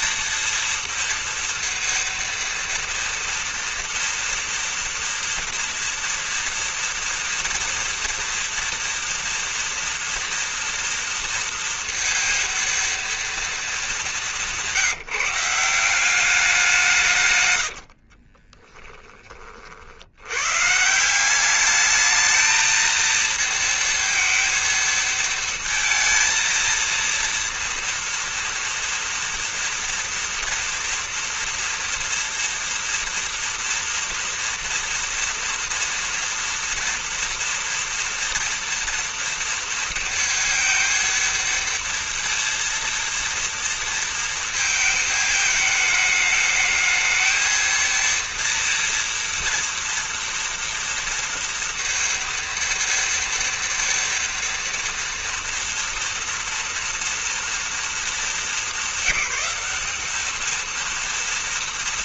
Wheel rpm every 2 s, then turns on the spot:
230, 230, 230, 230, 230, 230, 230, 190, 190, 50, 90, 220, 230, 230, 230, 230, 230, 230, 230, 230, 230, 230, 230, 210, 230, 230, 230, 230, 230, 210, 210.
18-20